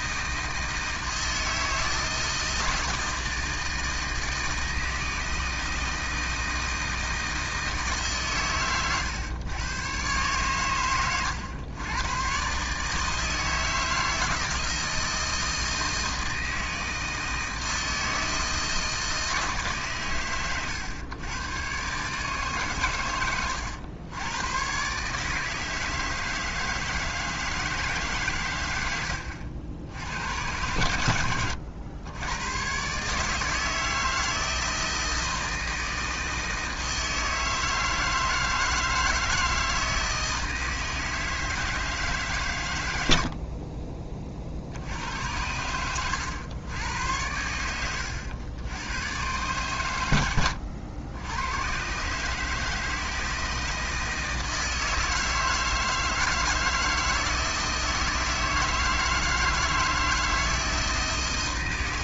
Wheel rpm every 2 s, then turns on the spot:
160, 160, 160, 160, 120, 110, 150, 160, 160, 160, 110, 110, 140, 160, 100, 100, 130, 160, 160, 160, 160, 80, 80, 90, 120, 90, 160, 160, 160, 160, 160.
28-30